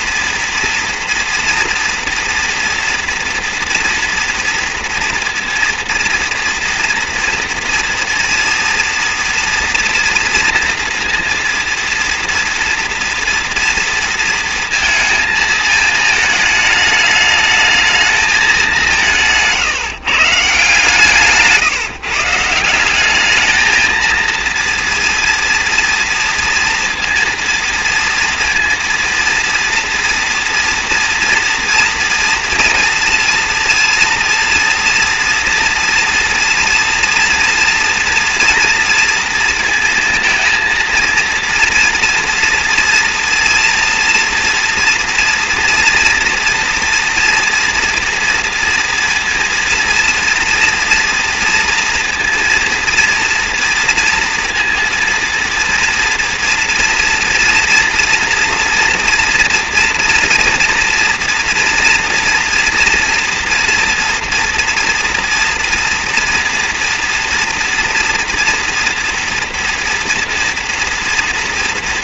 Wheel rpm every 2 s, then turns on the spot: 230, 240, 230, 230, 240, 230, 240, 230, 220, 190, 150, 180, 230, 230, 230, 240, 230, 230, 230, 230, 230, 230, 230, 240, 230, 230, 230, 230, 230, 240, 230, 230, 230, 240, 230, 230.
none